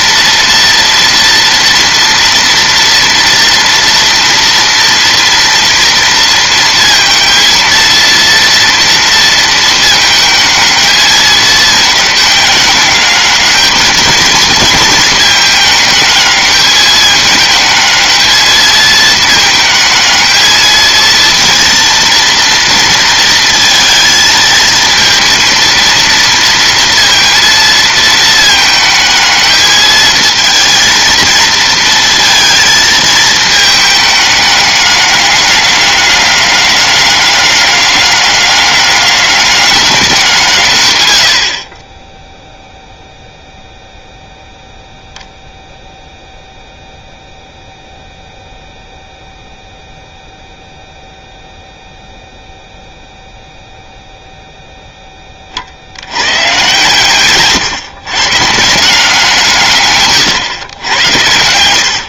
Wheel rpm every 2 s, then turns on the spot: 230, 230, 230, 230, 230, 220, 210, 220, 210, 220, 230, 230, 230, 230, 220, 220, 220, 210, 200, 200, 140, 0, 0, 0, 0, 0, 0, 0, 120, 130, 120.
none